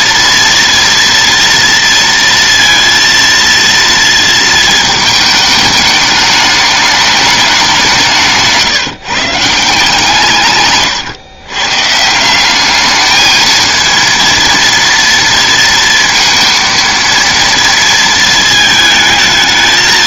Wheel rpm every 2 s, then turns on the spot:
230, 230, 220, 210, 150, 130, 210, 230, 230, 220.
10-12